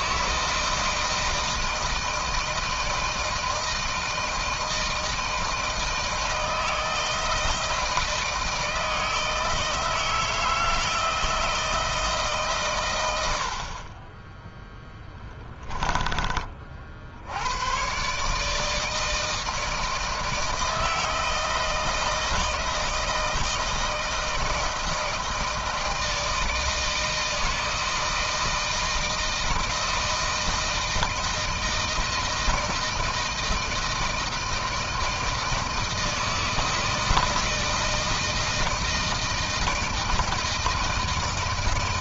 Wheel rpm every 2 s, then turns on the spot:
160, 160, 160, 160, 160, 160, 140, 10, 30, 150, 160, 160, 160, 160, 160, 160, 160, 160, 160, 160, 160.
none